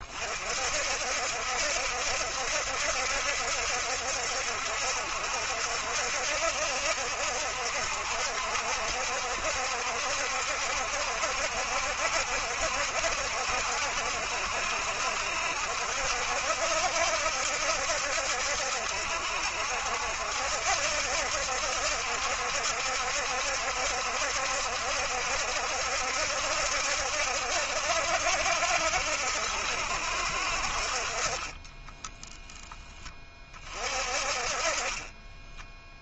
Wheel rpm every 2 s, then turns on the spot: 50, 70, 70, 70, 70, 70, 70, 70, 70, 70, 70, 70, 70, 70, 60, 50, 10, 30.
none